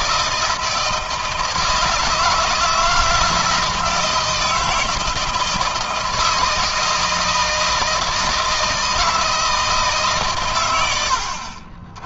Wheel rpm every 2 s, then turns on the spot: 160, 160, 160, 160, 160, 90.
none